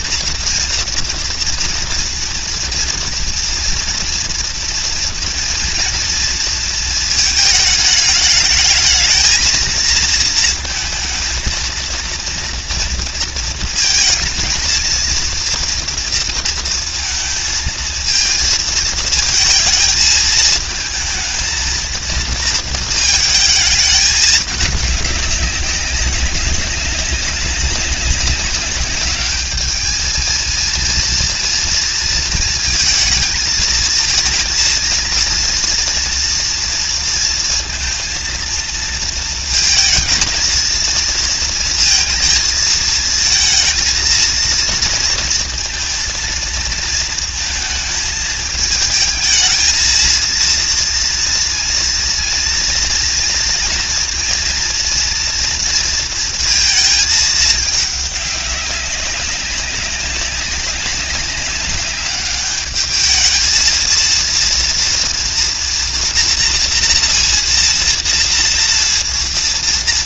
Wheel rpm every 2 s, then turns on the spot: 230, 230, 230, 230, 220, 220, 230, 230, 230, 230, 220, 230, 210, 190, 200, 220, 230, 230, 230, 230, 220, 230, 230, 230, 220, 220, 230, 230, 230, 210, 190, 200, 220, 240, 230.
none